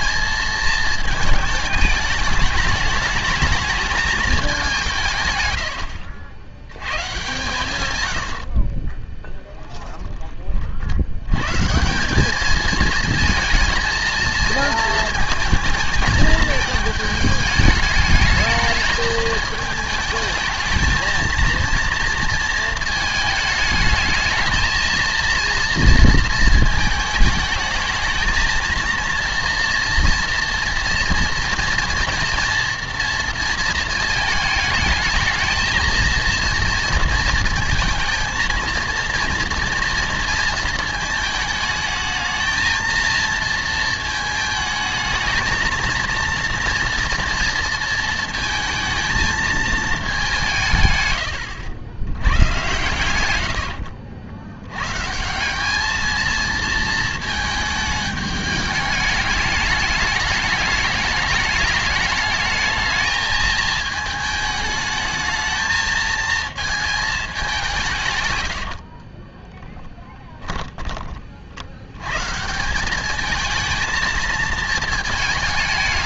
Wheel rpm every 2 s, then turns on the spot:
220, 210, 190, 100, 60, 40, 210, 220, 220, 220, 220, 230, 220, 220, 230, 230, 230, 220, 230, 220, 230, 230, 220, 230, 220, 160, 110, 100, 230, 210, 210, 220, 220, 230, 100, 10, 170, 230.
8-10 68-72